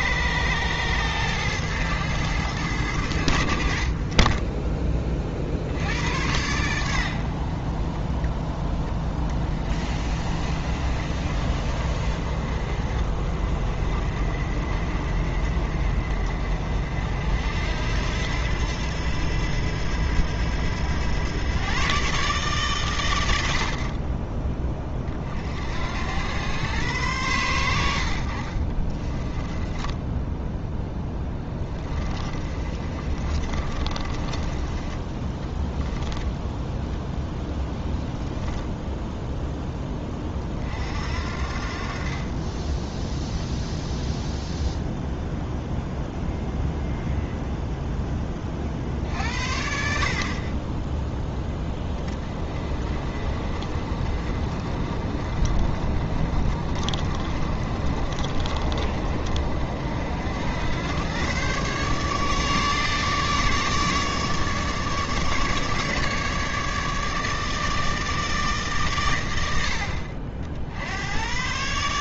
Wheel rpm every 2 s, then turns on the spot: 110, 100, 20, 90, 20, 40, 40, 50, 50, 90, 90, 140, 30, 110, 30, 10, 30, 20, 0, 0, 50, 10, 0, 0, 50, 10, 30, 40, 40, 50, 100, 150, 150, 150, 140, 60.
28-36